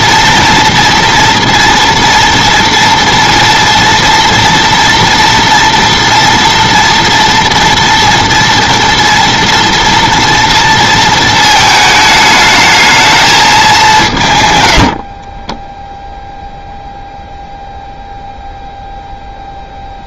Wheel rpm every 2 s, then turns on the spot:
230, 240, 240, 240, 230, 230, 220, 60, 0, 0.
14-16